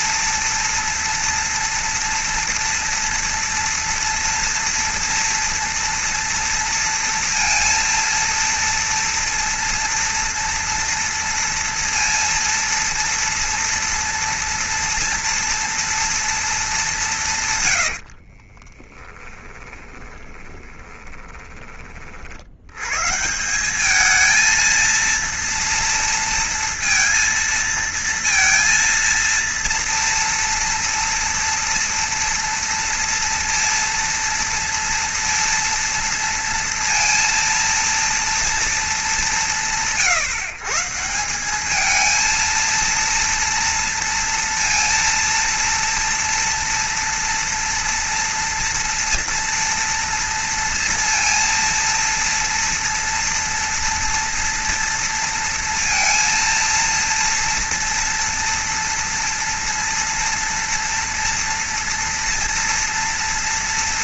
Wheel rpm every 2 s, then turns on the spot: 240, 230, 230, 230, 230, 230, 230, 230, 210, 30, 30, 110, 230, 230, 230, 230, 230, 230, 230, 210, 150, 230, 230, 240, 230, 230, 230, 230, 230, 230, 230, 230.
18-22